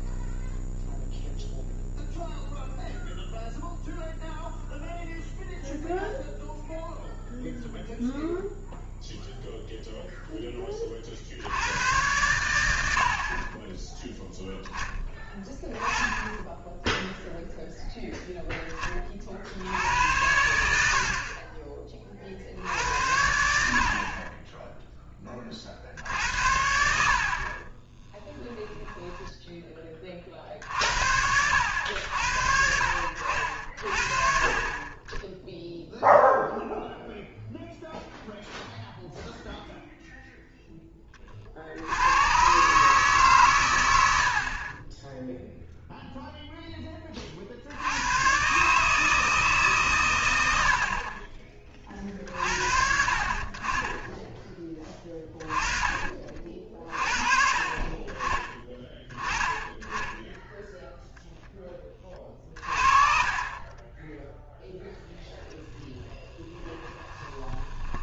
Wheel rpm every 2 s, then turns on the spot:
0, 0, 0, 0, 0, 30, 80, 0, 0, 10, 80, 70, 10, 60, 10, 60, 70, 20, 0, 0, 0, 130, 30, 10, 140, 80, 50, 20, 40, 20, 0, 30, 10, 20.
66-68